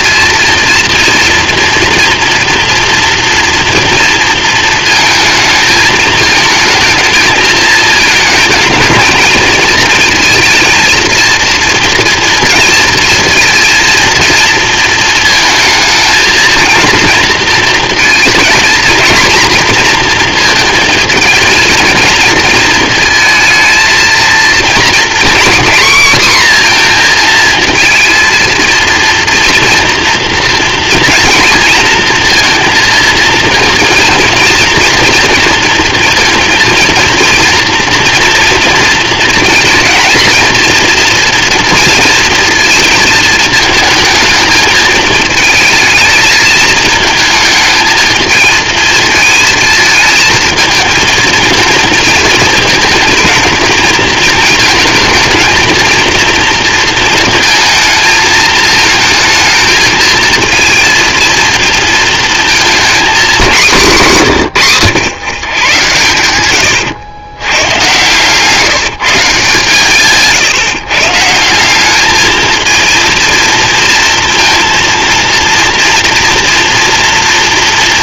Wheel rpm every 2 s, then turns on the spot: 230, 230, 220, 220, 220, 230, 230, 230, 230, 230, 230, 230, 240, 240, 230, 230, 230, 240, 230, 230, 230, 220, 220, 220, 220, 230, 220, 220, 230, 220, 230, 230, 120, 110, 160, 150, 230, 230, 230.
none